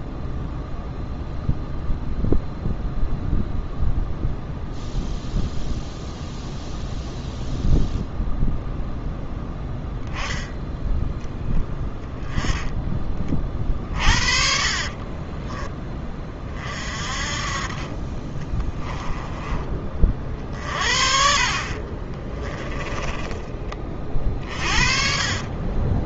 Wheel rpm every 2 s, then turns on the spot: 0, 0, 0, 0, 0, 10, 20, 40, 40, 10, 50, 10, 40.
14-16 18-20 22-26